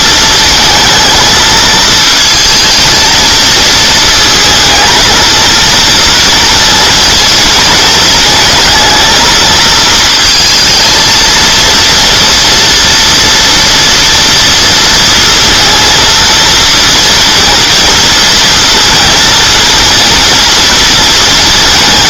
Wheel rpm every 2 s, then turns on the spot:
220, 220, 220, 230, 230, 220, 240, 230, 230, 230, 230.
none